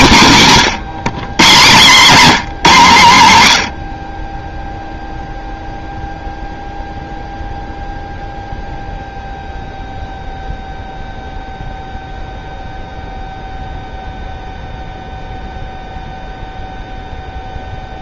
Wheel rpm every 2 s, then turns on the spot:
200, 200, 0, 0, 0, 0, 0, 0, 0.
none